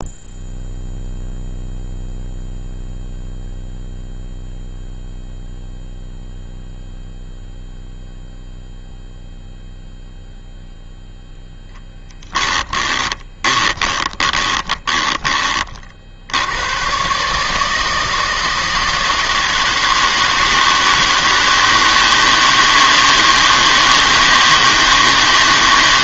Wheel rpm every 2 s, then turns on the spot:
0, 0, 0, 0, 0, 0, 20, 20, 120, 160, 160, 160, 160.
12-16